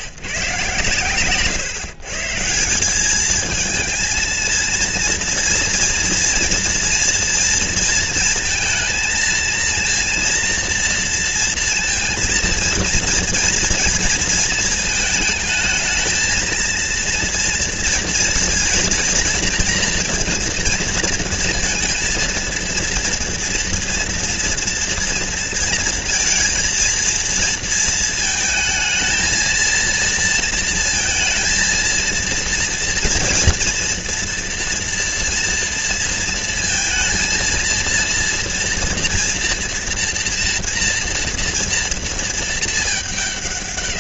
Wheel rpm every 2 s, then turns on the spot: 120, 200, 230, 230, 220, 230, 230, 220, 230, 230, 230, 230, 230, 230, 220, 230, 230, 230, 230, 230, 230, 210.
none